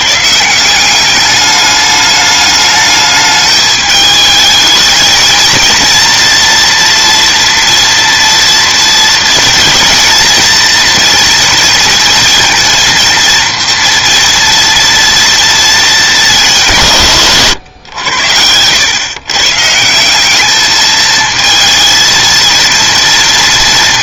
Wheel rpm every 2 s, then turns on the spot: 180, 210, 220, 240, 230, 230, 230, 230, 170, 110, 220, 230.
none